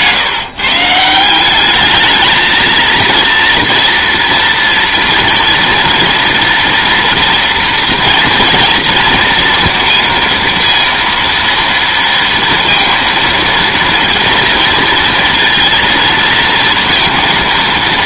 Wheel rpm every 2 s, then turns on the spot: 160, 230, 230, 230, 230, 230, 230, 230, 230.
none